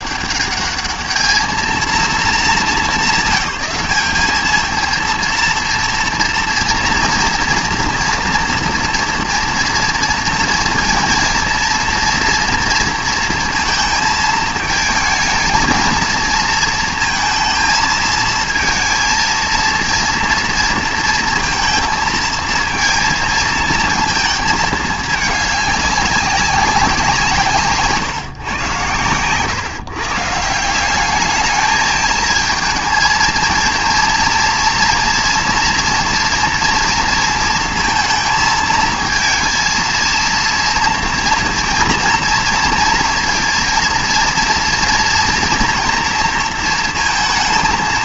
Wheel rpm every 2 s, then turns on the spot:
210, 190, 220, 230, 230, 230, 230, 220, 230, 230, 230, 230, 210, 180, 130, 180, 220, 230, 230, 220, 230, 230, 240, 230.
none